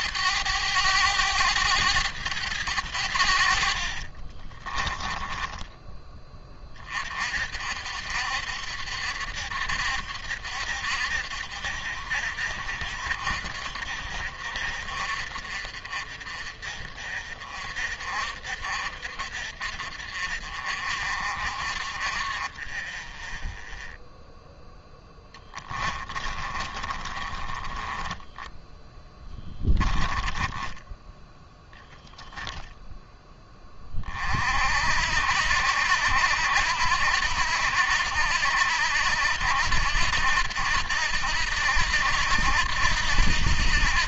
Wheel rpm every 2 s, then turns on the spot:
100, 90, 20, 30, 70, 70, 60, 60, 50, 50, 50, 20, 0, 30, 10, 10, 10, 60, 80, 80, 80, 80.
4-6 26-30